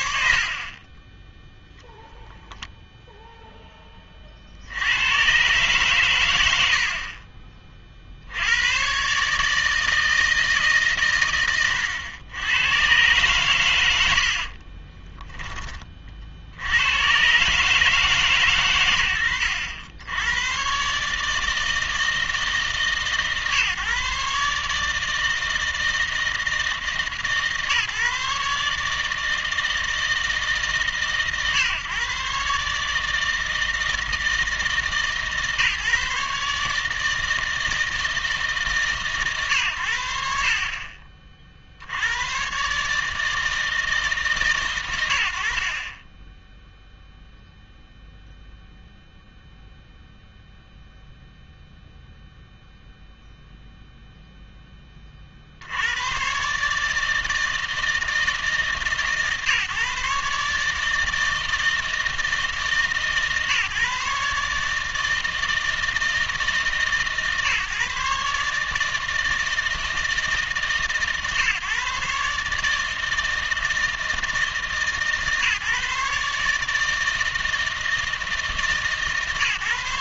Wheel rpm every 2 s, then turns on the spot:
60, 0, 90, 70, 110, 140, 110, 30, 90, 120, 130, 150, 150, 160, 150, 140, 150, 160, 150, 150, 50, 140, 110, 0, 0, 0, 0, 10, 150, 150, 150, 160, 150, 150, 150, 140, 150, 150, 150, 160.
14-16